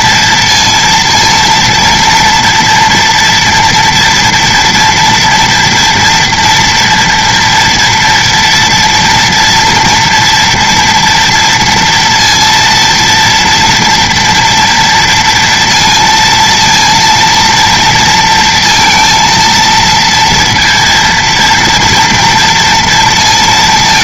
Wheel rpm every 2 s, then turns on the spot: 230, 240, 240, 230, 240, 230, 230, 230, 230, 230, 230, 230.
none